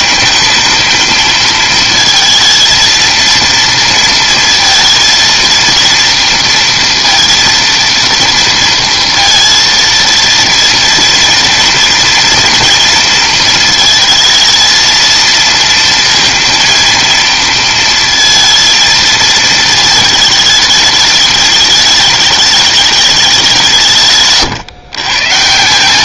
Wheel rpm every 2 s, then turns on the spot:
220, 230, 230, 230, 230, 230, 230, 220, 230, 220, 220, 210, 140.
none